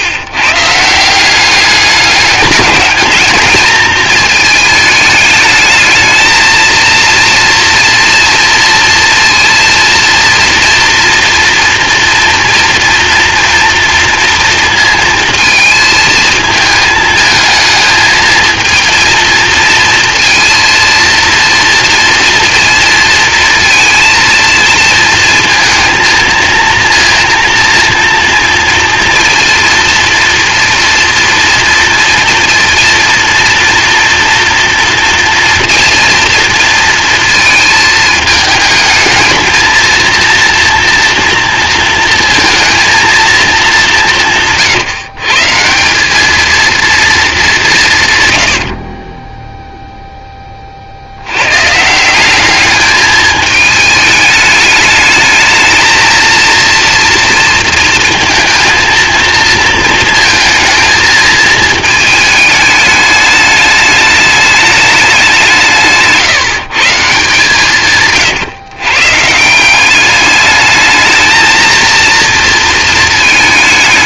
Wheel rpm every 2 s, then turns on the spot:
140, 210, 220, 230, 240, 230, 230, 230, 220, 230, 230, 230, 230, 230, 230, 230, 230, 230, 230, 220, 230, 230, 160, 230, 80, 20, 200, 210, 230, 220, 220, 210, 210, 160, 120, 210, 230.
44-46 48-50